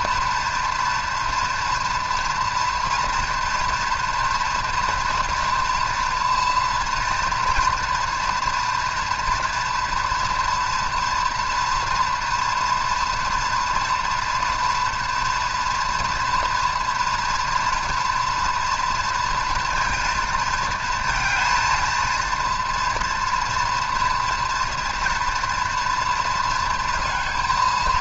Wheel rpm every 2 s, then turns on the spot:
230, 230, 240, 240, 230, 230, 240, 240, 230, 230, 230, 230, 230, 230.
none